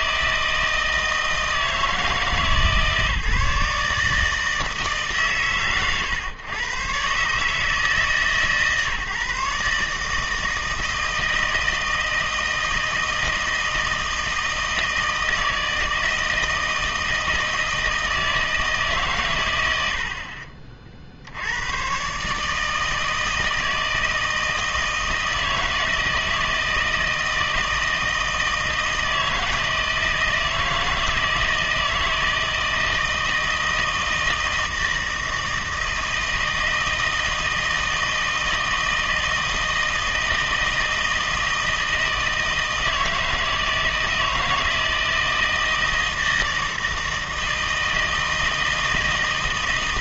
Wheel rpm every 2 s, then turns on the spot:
160, 150, 160, 110, 150, 160, 160, 160, 160, 160, 40, 150, 160, 160, 160, 160, 160, 160, 160, 160, 160, 160, 160, 160, 160.
none